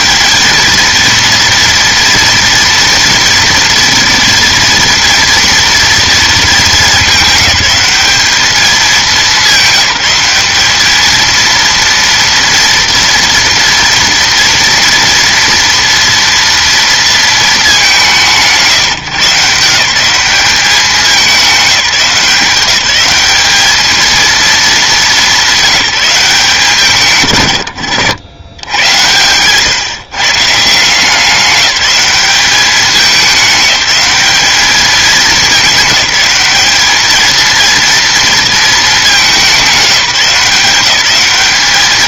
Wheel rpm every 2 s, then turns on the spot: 220, 230, 230, 220, 210, 200, 230, 230, 230, 160, 200, 200, 200, 160, 90, 160, 200, 200, 200, 220, 190.
none